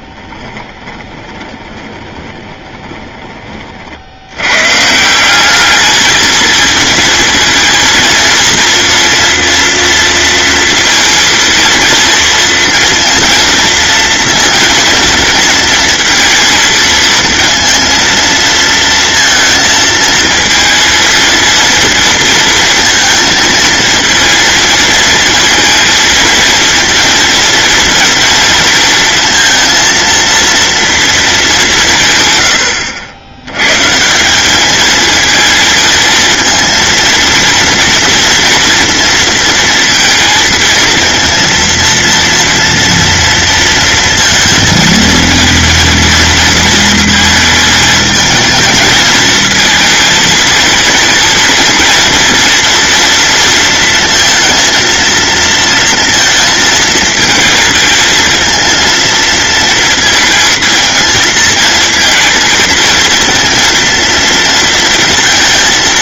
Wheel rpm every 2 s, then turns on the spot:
20, 20, 150, 220, 230, 230, 230, 220, 230, 230, 230, 230, 230, 230, 230, 230, 90, 220, 230, 230, 230, 230, 230, 220, 220, 230, 230, 230, 230, 230, 220, 220, 230.
0-4